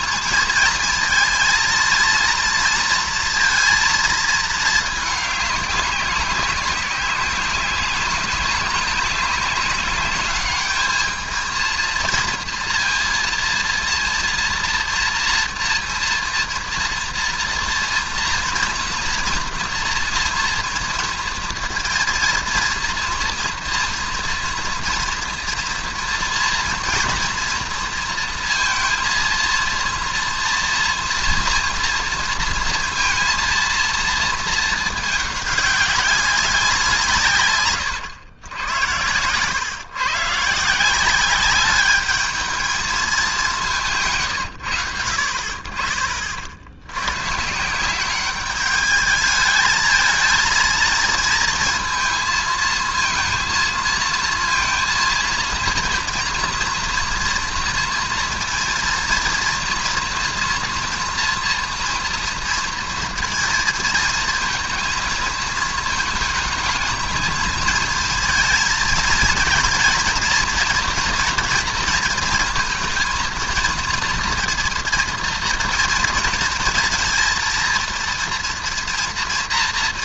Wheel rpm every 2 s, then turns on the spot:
220, 230, 220, 190, 200, 210, 230, 240, 240, 230, 230, 230, 230, 230, 230, 230, 230, 220, 180, 100, 160, 220, 100, 80, 210, 220, 230, 230, 240, 230, 230, 230, 230, 220, 230, 230, 220, 230, 230, 240.
none